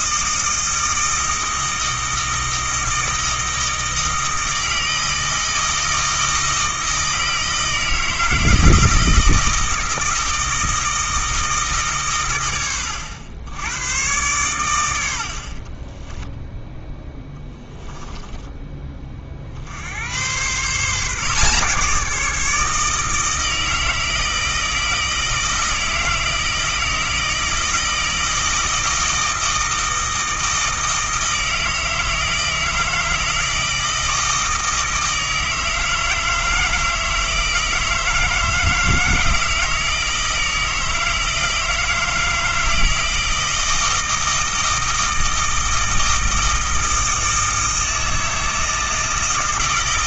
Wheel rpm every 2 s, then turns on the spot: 160, 160, 160, 160, 160, 160, 110, 120, 0, 10, 130, 160, 160, 160, 160, 160, 160, 160, 160, 160, 160, 160, 160, 160, 160.
none